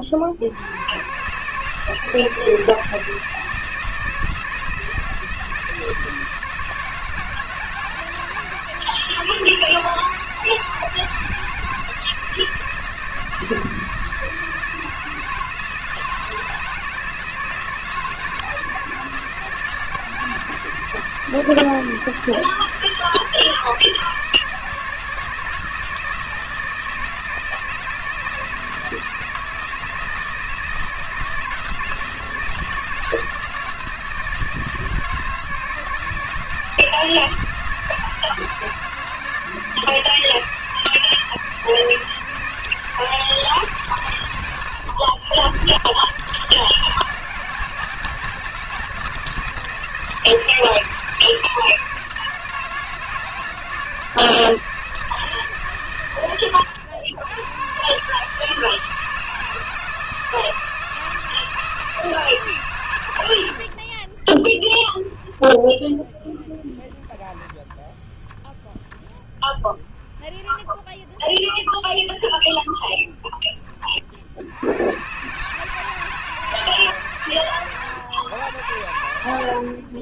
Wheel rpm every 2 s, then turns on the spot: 100, 170, 160, 160, 160, 160, 160, 160, 170, 160, 160, 160, 160, 160, 160, 160, 160, 160, 160, 160, 160, 160, 90, 160, 160, 160, 160, 160, 110, 160, 160, 120, 10, 0, 0, 10, 10, 110, 150, 90.
64-66 70-74